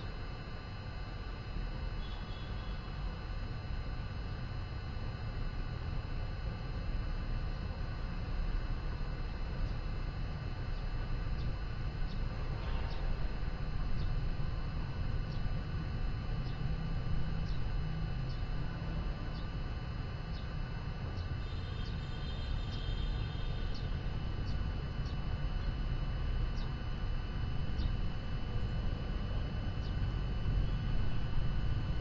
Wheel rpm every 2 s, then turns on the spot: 0, 0, 0, 0, 0, 0, 0, 0, 0, 0, 0, 0, 0, 0, 0, 0.
none